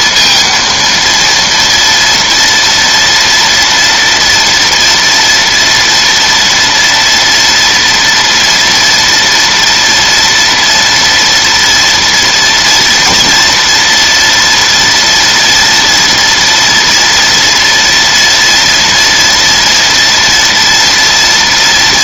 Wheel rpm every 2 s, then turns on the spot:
230, 230, 230, 230, 240, 230, 230, 230, 230, 230, 230.
none